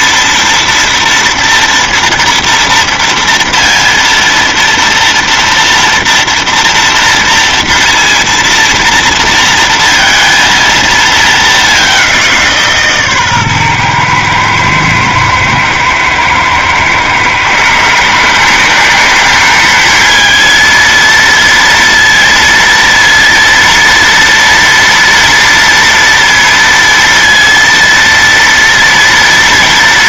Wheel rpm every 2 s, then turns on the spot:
230, 230, 230, 230, 230, 230, 160, 110, 120, 180, 230, 230, 230, 230, 230.
none